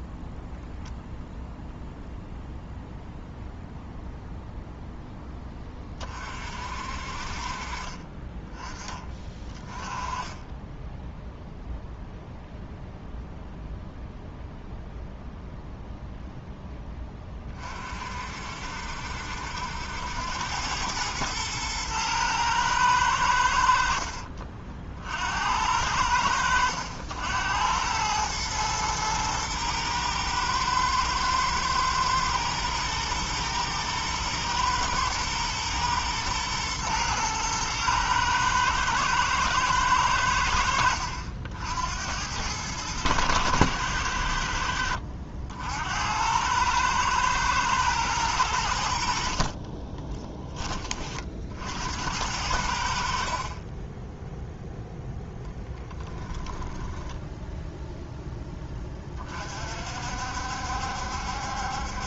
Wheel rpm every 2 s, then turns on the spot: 0, 0, 0, 50, 20, 10, 0, 0, 10, 60, 100, 110, 50, 80, 110, 110, 110, 110, 120, 110, 80, 100, 70, 110, 80, 30, 70, 0, 10, 20, 70.
56-58